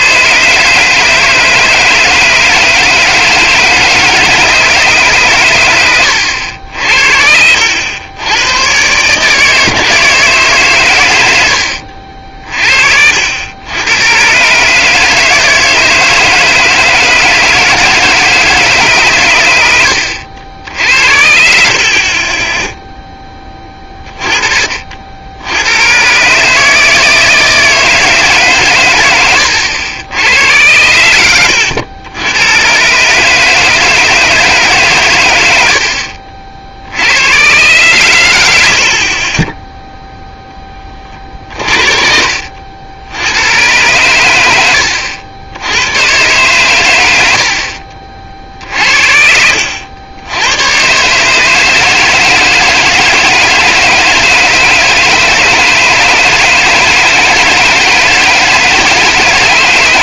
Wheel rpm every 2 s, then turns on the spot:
150, 160, 150, 70, 120, 130, 50, 140, 150, 150, 80, 10, 40, 150, 130, 90, 120, 150, 60, 80, 10, 70, 80, 120, 60, 110, 160, 160, 160, 160.
none